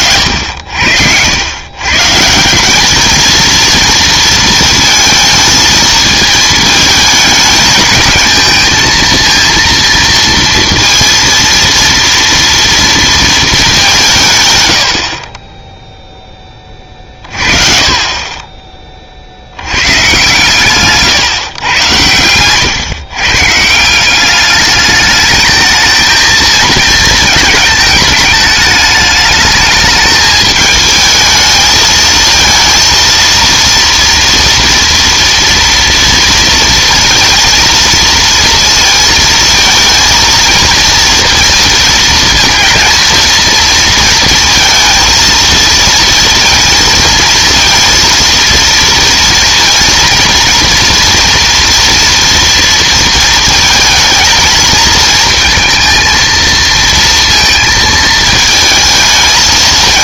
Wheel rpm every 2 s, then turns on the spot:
70, 190, 230, 220, 220, 230, 230, 110, 20, 30, 130, 110, 210, 220, 210, 220, 230, 230, 230, 230, 230, 230, 230, 230, 230, 230, 230, 220, 230, 220.
none